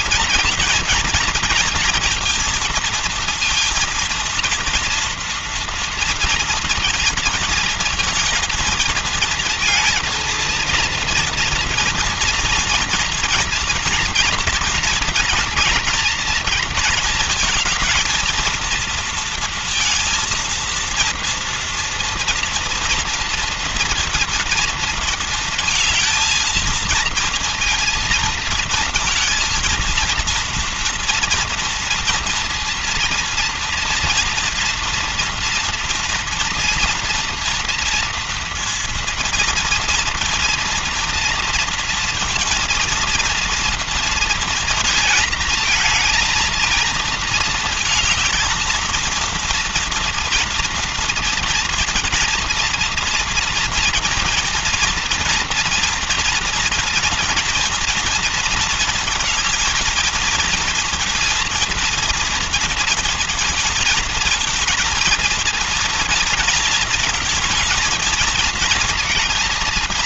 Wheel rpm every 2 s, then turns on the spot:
230, 230, 230, 230, 230, 230, 240, 230, 220, 220, 230, 230, 230, 230, 230, 230, 230, 230, 230, 230, 230, 230, 230, 230, 220, 230, 230, 230, 230, 230, 230, 230, 230, 230, 230.
none